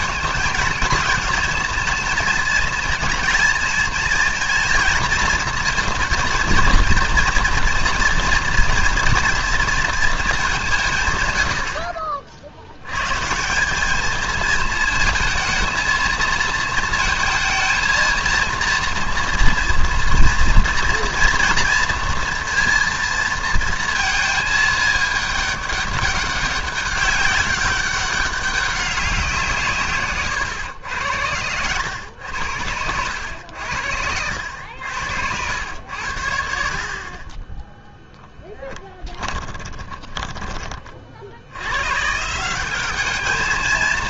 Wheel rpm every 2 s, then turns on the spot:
220, 230, 230, 230, 230, 200, 70, 220, 230, 230, 230, 230, 220, 200, 200, 120, 90, 90, 70, 10, 20, 170.
38-40